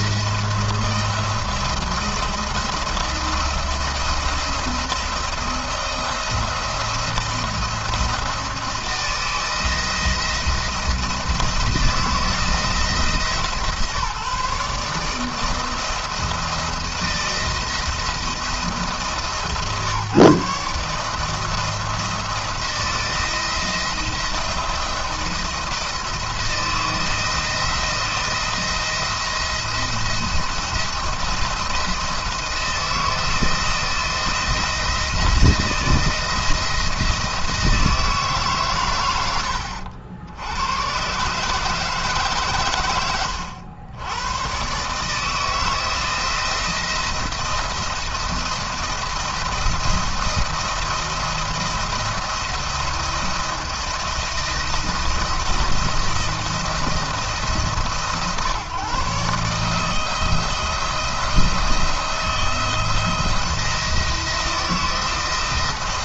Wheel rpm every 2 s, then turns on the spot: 170, 170, 170, 170, 170, 170, 170, 150, 170, 160, 150, 160, 170, 160, 170, 170, 170, 170, 170, 130, 90, 130, 120, 170, 170, 170, 170, 160, 170, 140, 160, 160, 160.
none